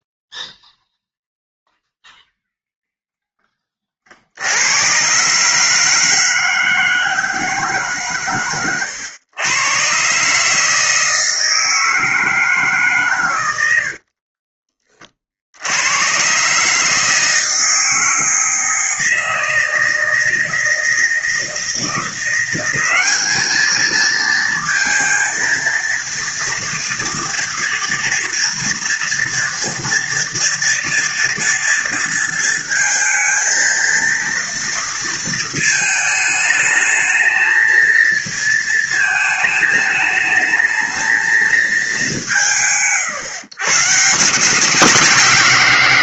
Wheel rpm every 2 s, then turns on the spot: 0, 0, 110, 160, 110, 160, 140, 50, 150, 160, 170, 200, 230, 230, 230, 230, 230, 230, 220, 220, 220, 140, 170.
none